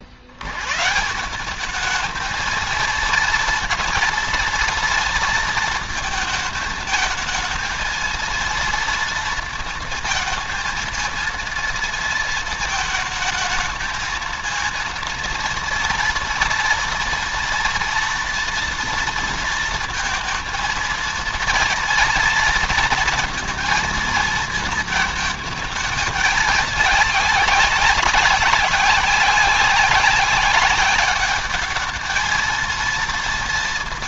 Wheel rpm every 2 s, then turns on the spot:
160, 230, 230, 220, 230, 230, 220, 230, 230, 230, 230, 230, 220, 210, 200, 200, 230.
none